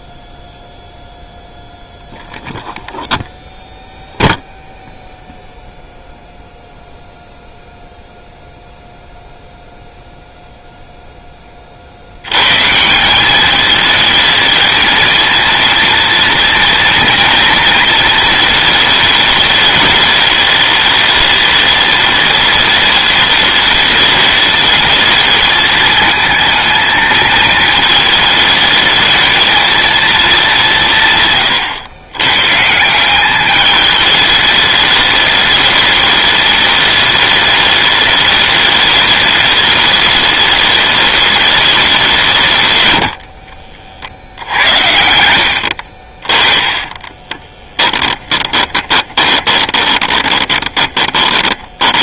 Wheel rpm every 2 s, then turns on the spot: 0, 0, 0, 0, 0, 0, 170, 230, 230, 210, 210, 210, 220, 220, 220, 150, 170, 210, 210, 210, 210, 100, 70, 20, 20, 20.
42-52